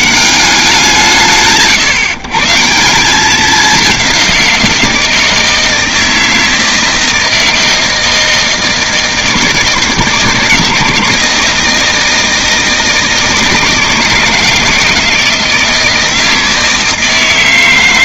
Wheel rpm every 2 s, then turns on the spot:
180, 160, 170, 160, 160, 160, 160, 160, 160.
none